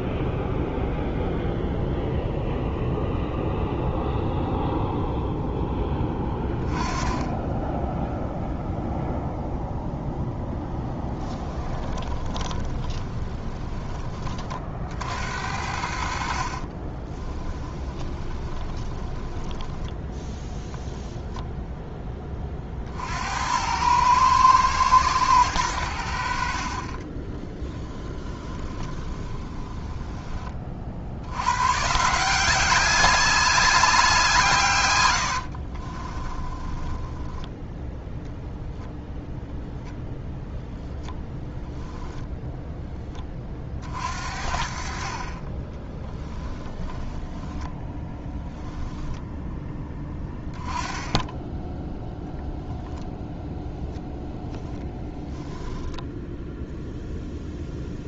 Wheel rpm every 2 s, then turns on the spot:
0, 0, 0, 20, 0, 10, 20, 70, 30, 20, 0, 60, 110, 30, 20, 50, 200, 110, 10, 10, 10, 10, 40, 10, 10, 10, 0, 0, 0.
10-14 16-20 26-30 36-40 46-48